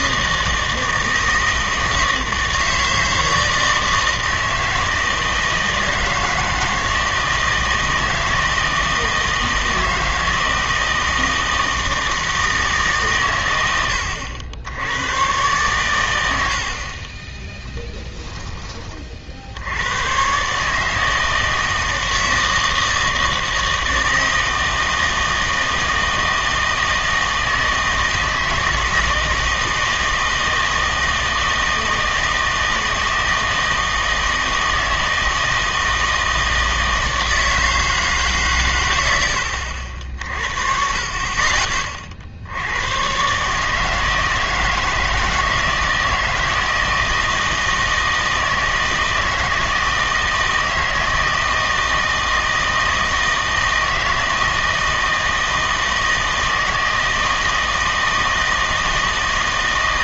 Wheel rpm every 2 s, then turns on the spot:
160, 160, 160, 160, 160, 160, 150, 80, 70, 20, 140, 160, 160, 160, 160, 160, 160, 160, 160, 120, 50, 80, 160, 160, 160, 160, 160, 160, 160, 160.
none